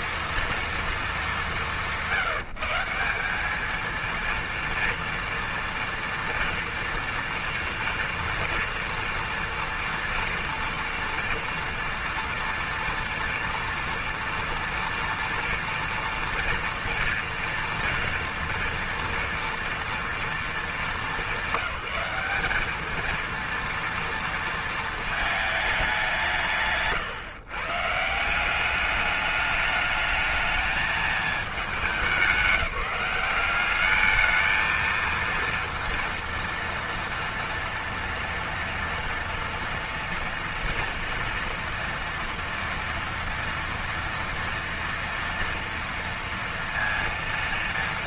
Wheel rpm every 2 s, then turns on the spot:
230, 170, 230, 240, 230, 230, 230, 230, 230, 230, 210, 220, 220, 140, 200, 220, 200, 220, 230, 230, 240, 230, 230, 230.
none